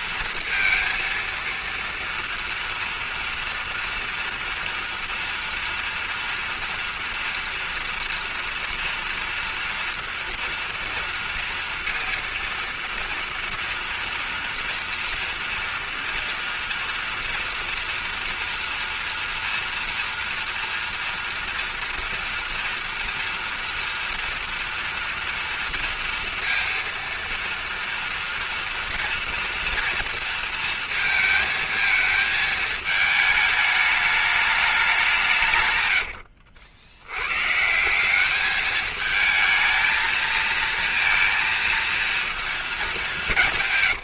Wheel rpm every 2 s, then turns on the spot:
230, 230, 240, 230, 240, 230, 230, 230, 240, 240, 240, 230, 230, 230, 230, 230, 220, 210, 80, 210, 230, 210.
none